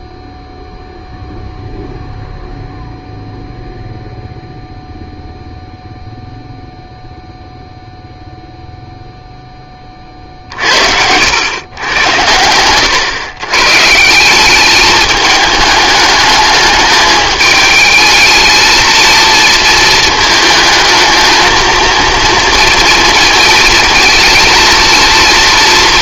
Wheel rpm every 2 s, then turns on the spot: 0, 0, 0, 0, 0, 60, 100, 200, 210, 220, 220, 230, 220.
none